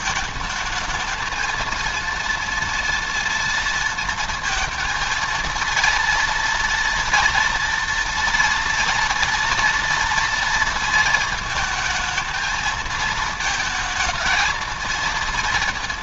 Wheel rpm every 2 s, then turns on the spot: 220, 230, 230, 230, 230, 230, 220, 230.
none